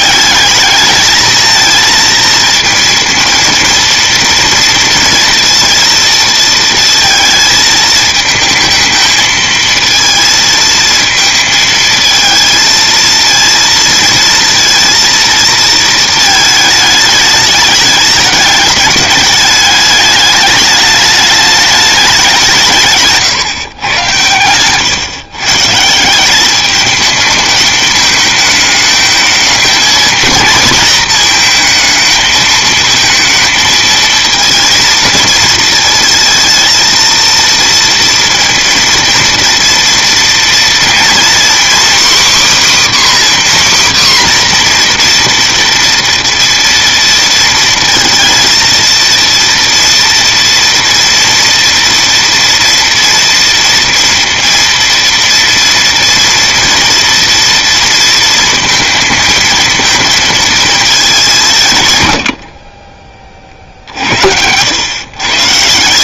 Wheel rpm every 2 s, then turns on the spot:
210, 230, 230, 230, 220, 230, 220, 230, 220, 210, 210, 160, 110, 200, 220, 220, 230, 220, 230, 230, 230, 290, 250, 230, 230, 230, 230, 230, 230, 230, 230, 40, 100.
none